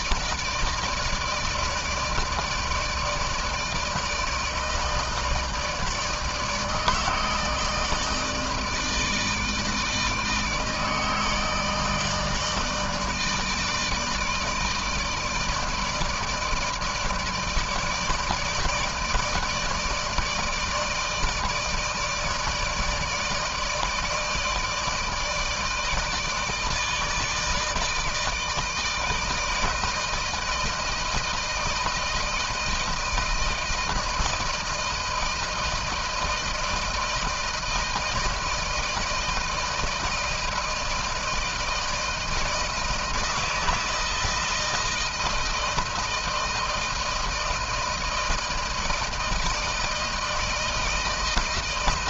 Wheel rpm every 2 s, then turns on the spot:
160, 160, 160, 160, 160, 160, 160, 160, 150, 160, 160, 150, 160, 160, 160, 160, 160, 160, 160, 160, 160, 160, 160, 160, 160, 160.
none